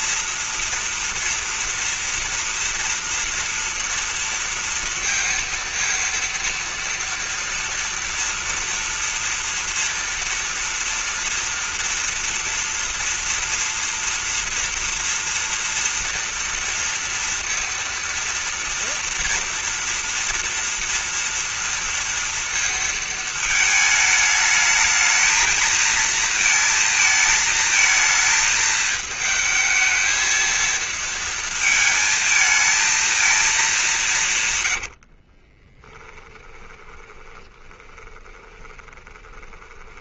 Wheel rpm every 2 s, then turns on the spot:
240, 230, 230, 230, 230, 230, 230, 240, 230, 230, 230, 230, 210, 230, 220, 220, 220, 90, 20, 20.
34-40